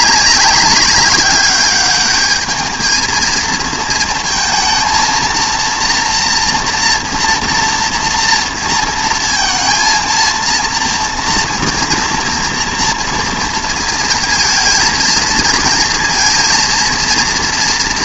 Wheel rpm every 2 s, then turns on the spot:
200, 220, 230, 240, 230, 230, 230, 220, 230.
none